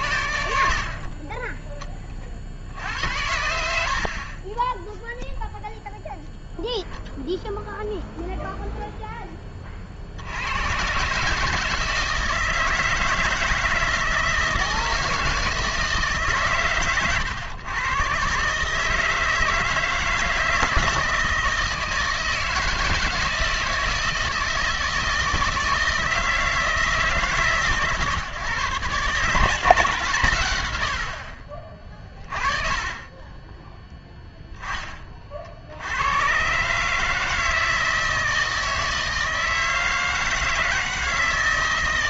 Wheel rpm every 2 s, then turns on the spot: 60, 60, 20, 0, 0, 110, 160, 160, 130, 140, 160, 160, 160, 170, 130, 110, 40, 10, 130, 160, 160.
none